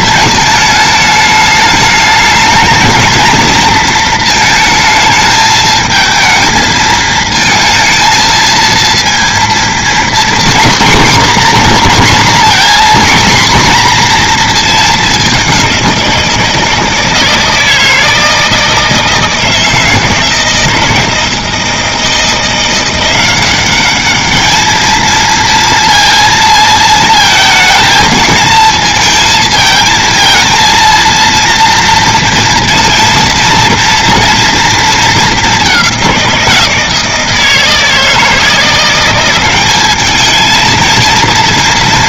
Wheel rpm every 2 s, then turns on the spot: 220, 230, 220, 220, 230, 250, 250, 220, 160, 160, 160, 170, 220, 230, 220, 230, 230, 230, 170, 170, 230.
none